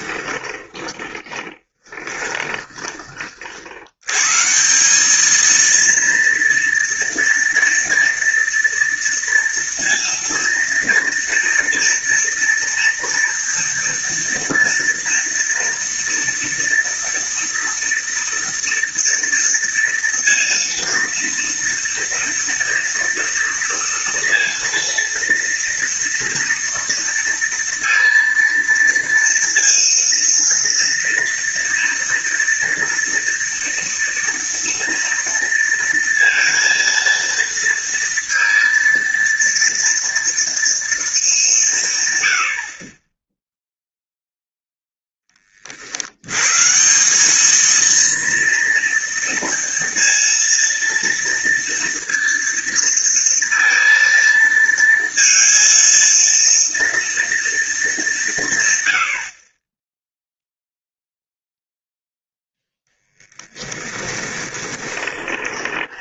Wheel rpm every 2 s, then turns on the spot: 20, 20, 200, 230, 230, 230, 230, 230, 230, 230, 230, 230, 230, 240, 230, 230, 230, 230, 230, 230, 220, 30, 10, 180, 230, 230, 230, 230, 230, 80, 0, 10, 20.
0-2 64-66